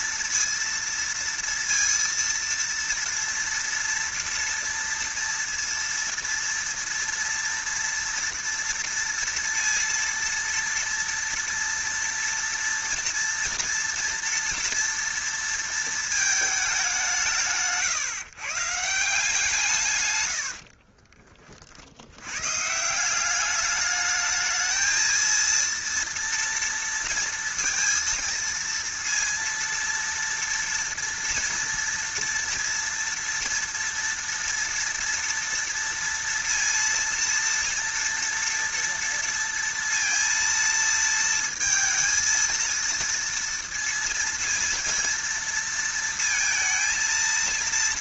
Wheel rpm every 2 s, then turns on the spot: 230, 230, 230, 230, 230, 230, 230, 230, 210, 140, 80, 130, 220, 230, 230, 240, 230, 230, 230, 230, 230, 230, 230, 220.
20-22